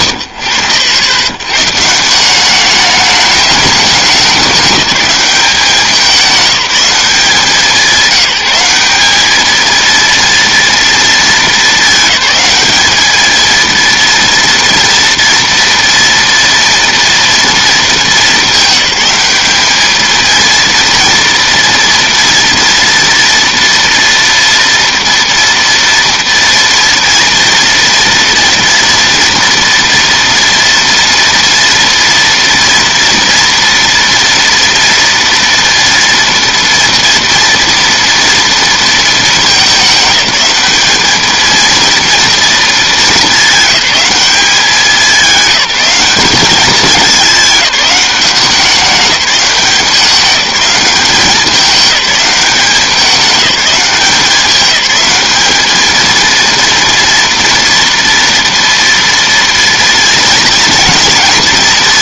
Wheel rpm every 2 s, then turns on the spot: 110, 200, 200, 180, 200, 230, 220, 230, 230, 200, 230, 230, 230, 230, 230, 230, 230, 230, 230, 220, 210, 210, 200, 200, 190, 200, 200, 200, 230, 230, 230.
none